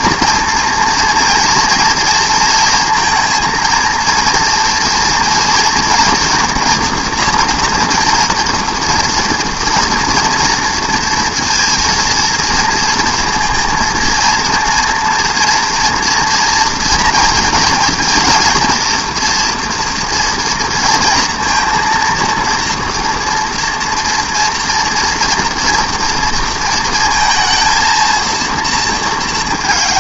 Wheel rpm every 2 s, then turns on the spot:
230, 230, 230, 230, 230, 230, 230, 230, 230, 230, 230, 230, 230, 230, 220.
none